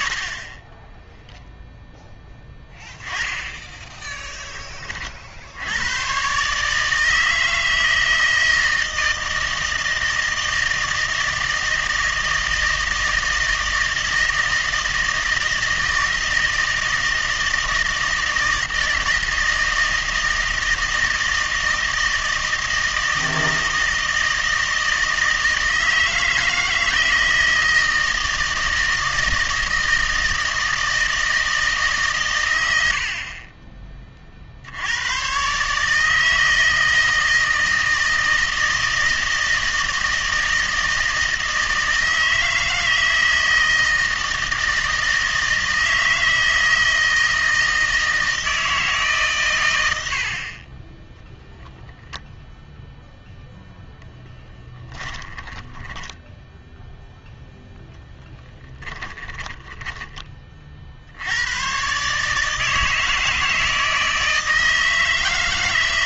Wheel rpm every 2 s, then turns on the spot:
30, 10, 30, 150, 160, 160, 160, 160, 160, 160, 160, 160, 160, 160, 160, 160, 90, 70, 160, 160, 160, 160, 160, 160, 160, 30, 0, 10, 0, 10, 50, 150, 160.
54-56 58-60